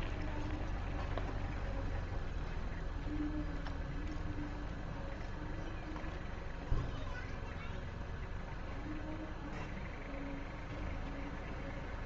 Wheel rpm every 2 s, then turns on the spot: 0, 0, 0, 0, 0, 0.
none